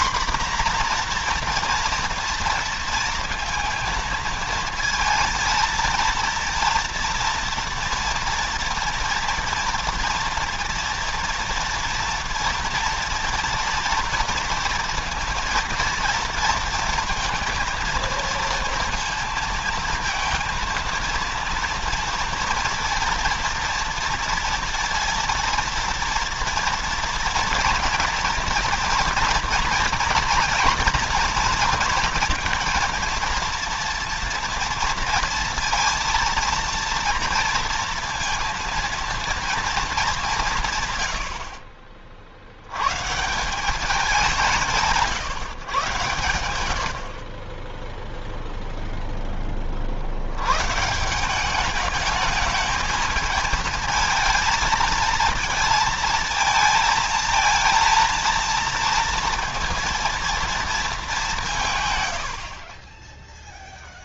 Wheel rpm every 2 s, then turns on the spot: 240, 230, 230, 230, 230, 230, 230, 230, 230, 230, 230, 230, 230, 230, 240, 230, 230, 230, 230, 230, 140, 90, 170, 90, 0, 120, 220, 220, 230, 230, 220, 40.
none